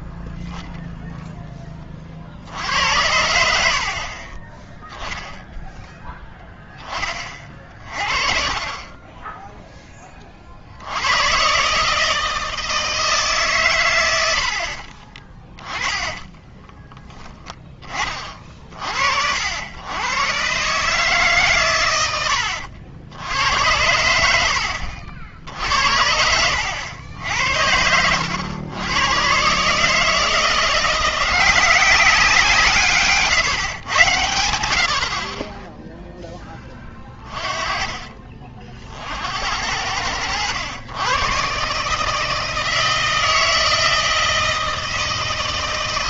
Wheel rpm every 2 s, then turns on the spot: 0, 70, 10, 10, 40, 60, 160, 50, 10, 50, 140, 80, 80, 80, 100, 170, 160, 80, 10, 40, 100, 160, 160.
14-18 24-26